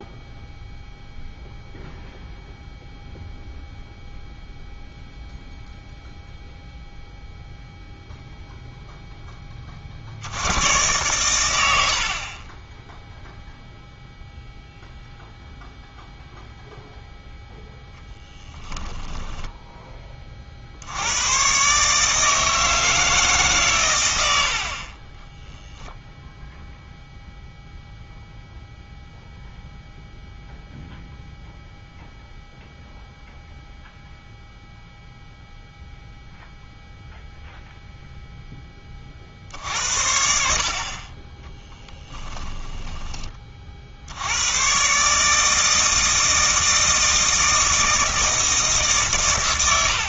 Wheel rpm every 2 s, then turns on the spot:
0, 0, 0, 0, 0, 100, 10, 0, 0, 10, 60, 160, 50, 0, 0, 0, 0, 0, 0, 10, 50, 10, 120, 160, 150.
12-14 18-20 24-26